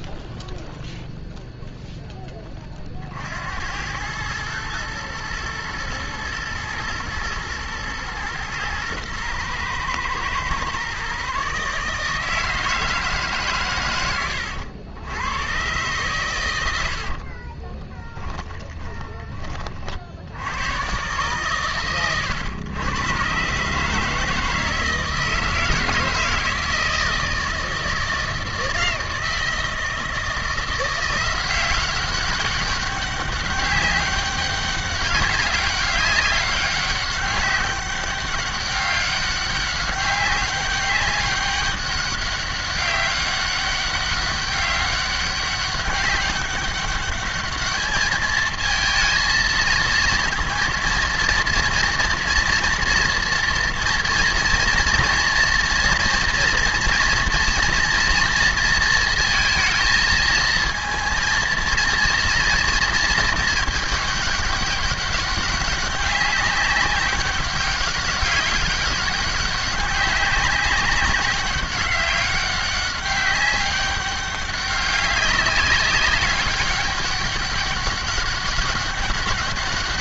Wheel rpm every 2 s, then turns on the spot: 0, 40, 110, 120, 120, 130, 160, 80, 80, 20, 110, 110, 160, 160, 160, 170, 200, 200, 200, 200, 200, 200, 200, 200, 230, 230, 230, 230, 230, 230, 230, 230, 200, 190, 200, 200, 190, 200, 200, 200.
18-20